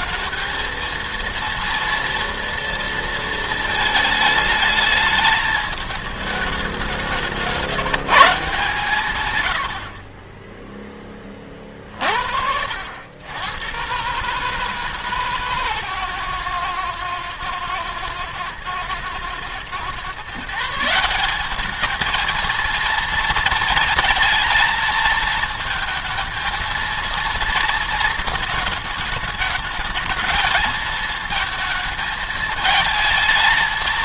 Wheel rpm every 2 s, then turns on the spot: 220, 230, 220, 210, 160, 10, 60, 140, 130, 110, 150, 220, 230, 220, 220, 220, 220.
none